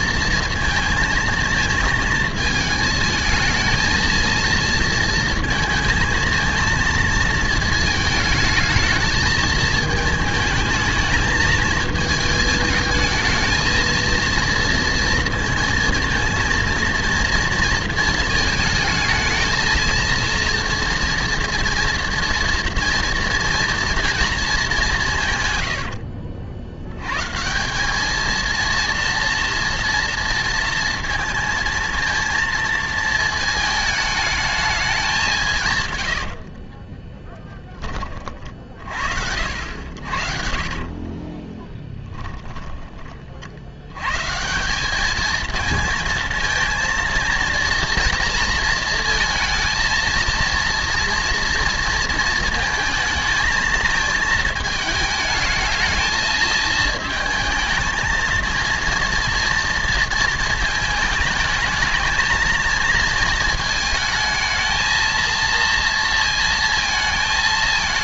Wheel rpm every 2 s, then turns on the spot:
230, 220, 230, 230, 220, 220, 220, 230, 230, 220, 230, 230, 210, 70, 230, 230, 230, 210, 30, 50, 40, 10, 190, 230, 230, 230, 220, 220, 220, 230, 220, 220, 220, 230.
36-38 40-44